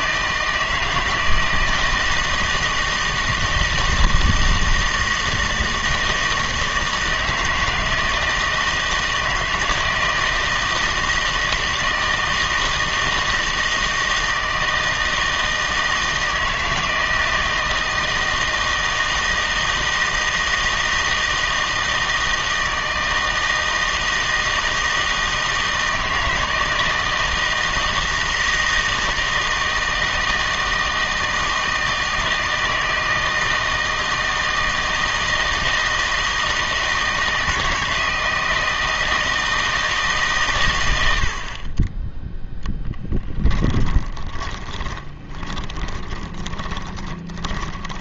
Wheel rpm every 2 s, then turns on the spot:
160, 160, 160, 160, 160, 160, 160, 160, 160, 160, 160, 160, 160, 160, 160, 160, 160, 160, 160, 160, 90, 10, 20, 20.
42-48